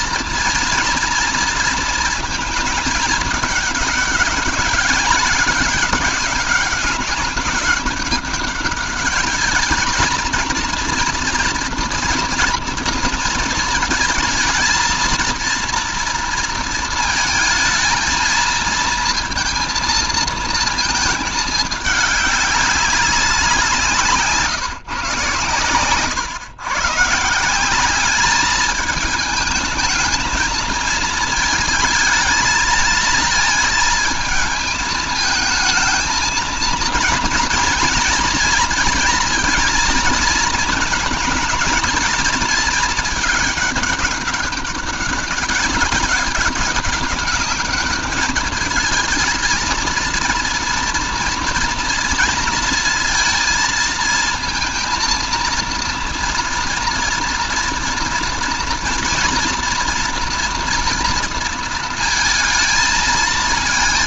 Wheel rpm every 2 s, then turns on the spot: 230, 220, 200, 200, 200, 230, 220, 230, 220, 220, 220, 200, 150, 160, 210, 220, 220, 220, 230, 230, 230, 220, 200, 200, 220, 240, 230, 230, 230, 230, 230, 230.
none